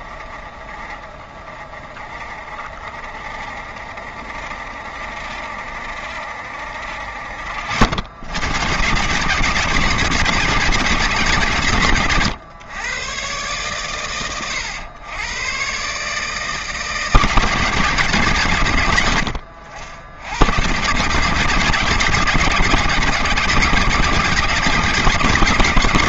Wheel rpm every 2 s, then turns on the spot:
20, 30, 30, 40, 140, 130, 120, 100, 150, 70, 140, 140, 150.
none